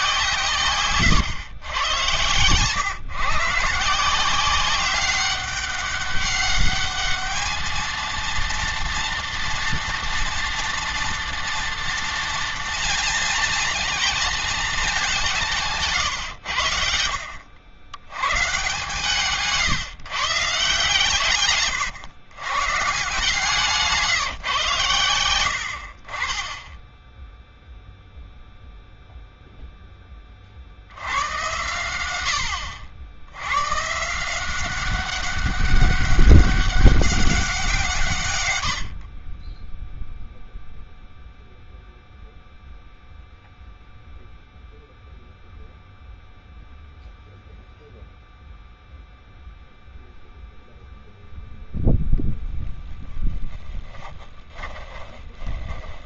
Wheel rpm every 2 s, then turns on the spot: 140, 130, 190, 210, 230, 230, 230, 210, 80, 140, 150, 140, 120, 10, 0, 60, 80, 190, 200, 90, 0, 0, 0, 0, 0, 0, 10, 20.
52-56